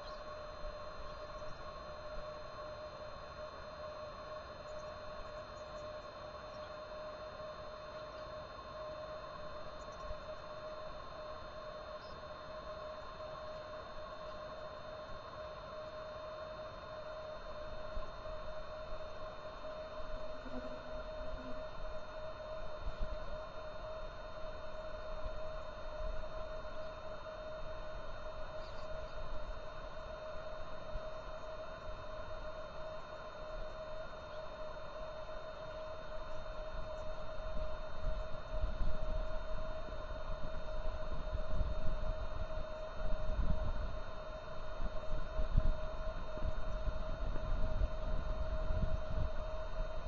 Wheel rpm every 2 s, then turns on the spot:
0, 0, 0, 0, 0, 0, 0, 0, 0, 0, 0, 0, 0, 0, 0, 0, 0, 0, 0, 0, 0, 0, 0, 0, 0.
none